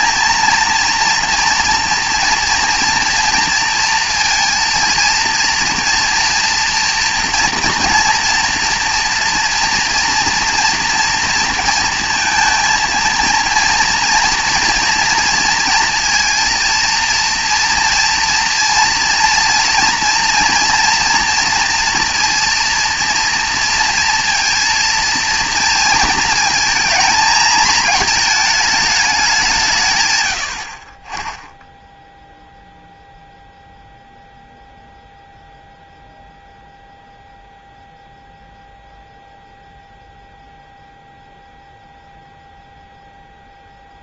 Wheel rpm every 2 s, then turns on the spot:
230, 230, 230, 230, 230, 240, 230, 230, 230, 230, 230, 230, 230, 220, 210, 30, 0, 0, 0, 0, 0, 0.
none